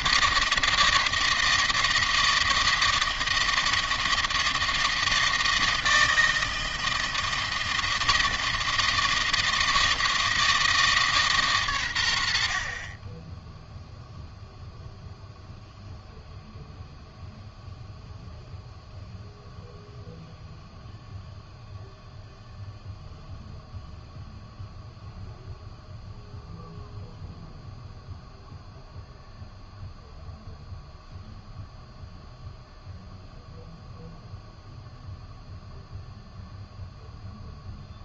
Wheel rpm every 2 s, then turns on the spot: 160, 160, 160, 160, 160, 150, 40, 0, 0, 0, 0, 0, 0, 0, 0, 0, 0, 0, 0.
none